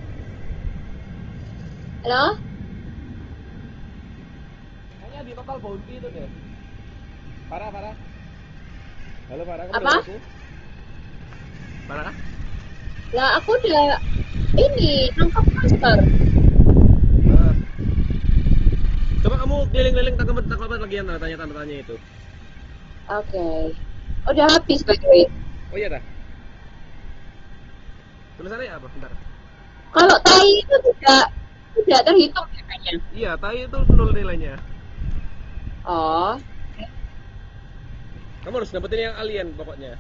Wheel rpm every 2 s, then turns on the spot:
0, 0, 0, 0, 0, 0, 0, 0, 0, 0, 0, 0, 0, 0, 0, 0, 0, 0, 0, 0.
none